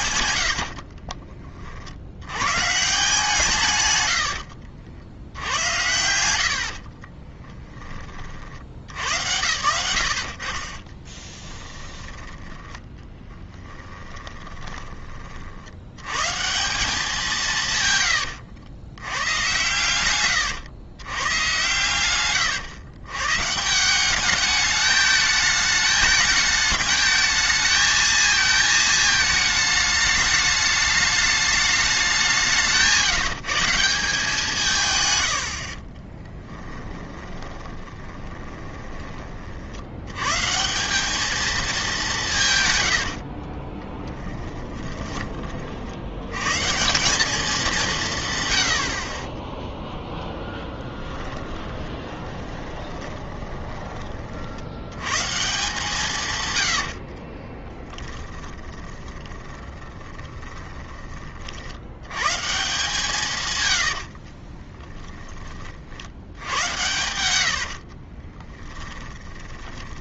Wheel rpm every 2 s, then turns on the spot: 70, 140, 70, 50, 80, 40, 10, 20, 180, 90, 110, 110, 210, 210, 220, 210, 170, 150, 10, 20, 160, 130, 20, 140, 90, 10, 20, 80, 100, 20, 20, 160, 40, 90, 10.
0-2 4-8 10-12 14-16 36-40 42-46 52-54 56-60 64-66 68-70